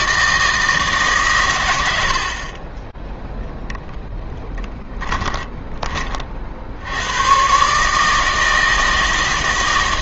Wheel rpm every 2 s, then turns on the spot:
160, 20, 10, 80, 160.
4-6